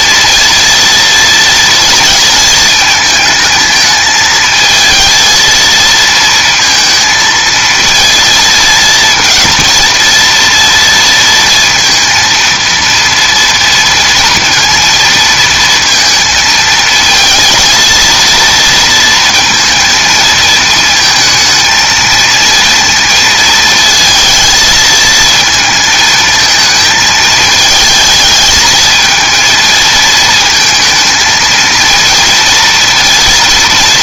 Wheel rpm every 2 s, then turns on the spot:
230, 220, 220, 230, 220, 230, 230, 230, 220, 230, 220, 230, 220, 220, 220, 220, 230.
none